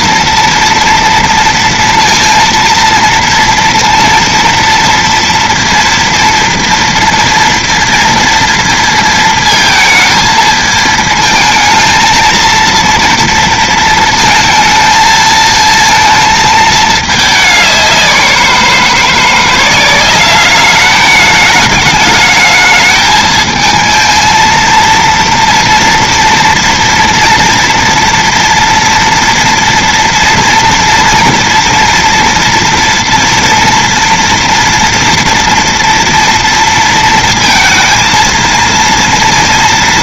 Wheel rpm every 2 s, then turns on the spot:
230, 230, 230, 230, 230, 220, 230, 230, 220, 180, 200, 220, 230, 230, 230, 230, 230, 230, 230, 230.
none